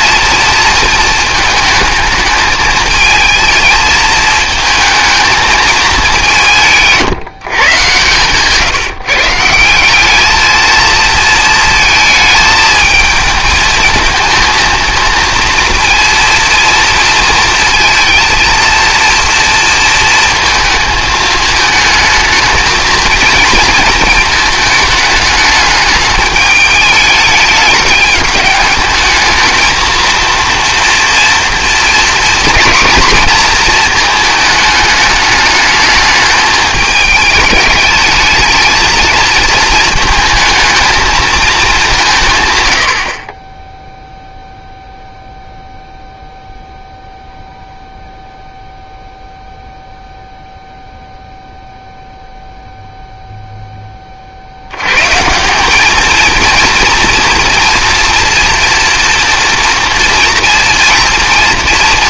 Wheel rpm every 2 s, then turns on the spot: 220, 220, 220, 160, 140, 220, 220, 230, 230, 230, 220, 220, 210, 210, 220, 230, 240, 210, 210, 230, 230, 110, 0, 0, 0, 0, 0, 100, 230, 230, 230.
none